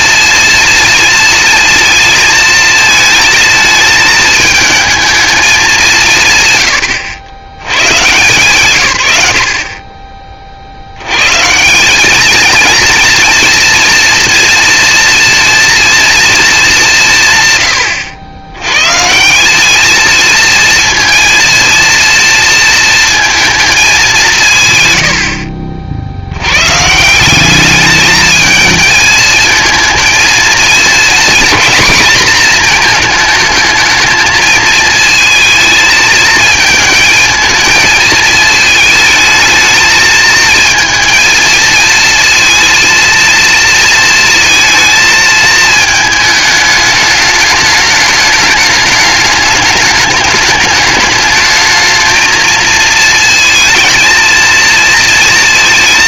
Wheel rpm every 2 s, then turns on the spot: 220, 220, 220, 130, 140, 40, 220, 230, 210, 110, 230, 230, 150, 110, 220, 220, 220, 220, 220, 220, 220, 230, 220, 210, 210, 210, 230, 230.
none